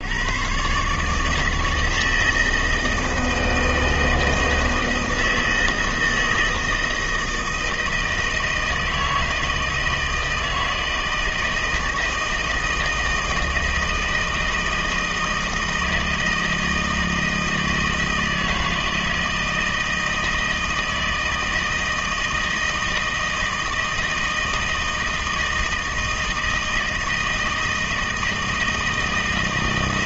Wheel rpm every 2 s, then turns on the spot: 100, 160, 160, 160, 160, 160, 160, 160, 160, 160, 160, 160, 160, 160, 160.
none